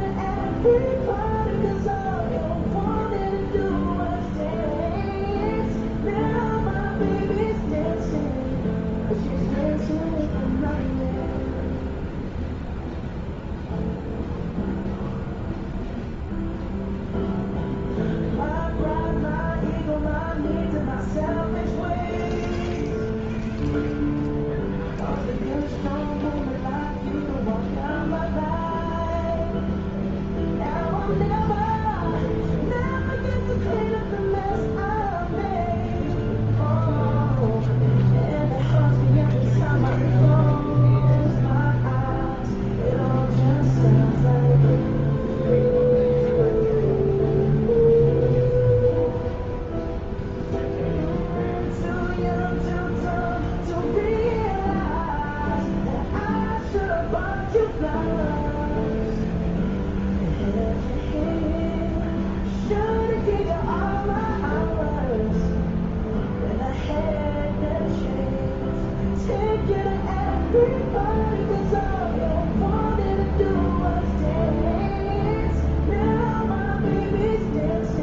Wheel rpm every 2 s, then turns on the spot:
0, 0, 0, 0, 0, 0, 0, 0, 0, 0, 0, 0, 0, 0, 0, 0, 0, 0, 0, 0, 0, 0, 0, 0, 0, 0, 0, 0, 0, 0, 0, 0, 0, 0, 0, 0, 0, 0, 0.
none